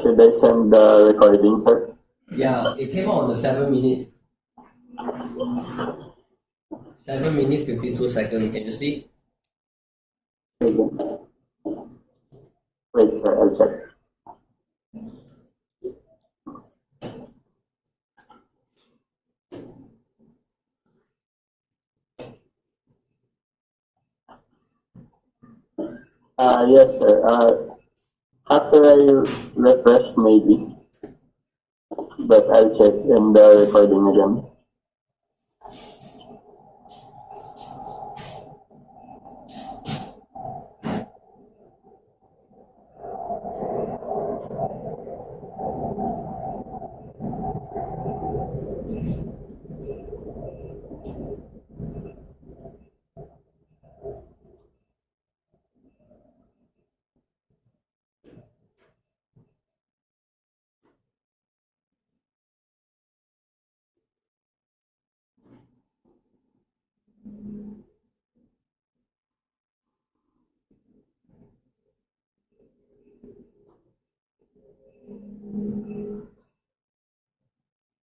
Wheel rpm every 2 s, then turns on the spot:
0, 0, 0, 0, 0, 0, 0, 0, 0, 0, 0, 0, 0, 0, 0, 0, 0, 0, 0, 0, 0, 0, 0, 0, 0, 0, 0, 0, 0, 0, 0, 0, 0, 0, 0, 0, 0, 0, 0.
none